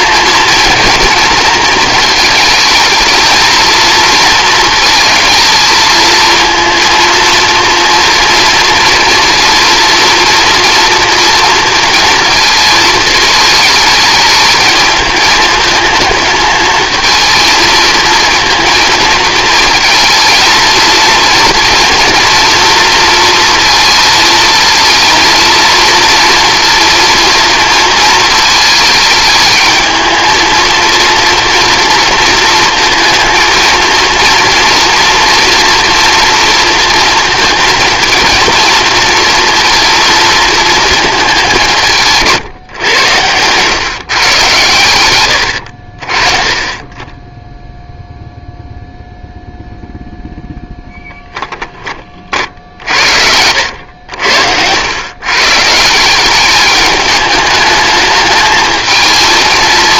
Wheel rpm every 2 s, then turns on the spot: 230, 220, 220, 230, 230, 230, 220, 220, 220, 230, 230, 230, 230, 230, 220, 230, 230, 230, 240, 230, 230, 140, 120, 30, 0, 0, 40, 80, 210, 220.
42-44